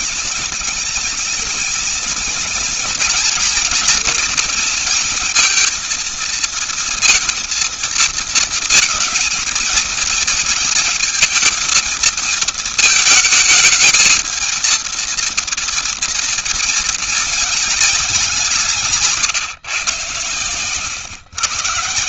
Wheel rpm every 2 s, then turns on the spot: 230, 230, 230, 230, 220, 230, 220, 230, 230, 170, 120.
none